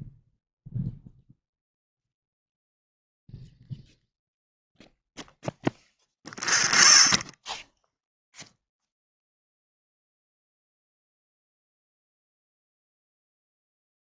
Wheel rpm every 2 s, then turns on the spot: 10, 0, 0, 0, 0, 0, 0.
none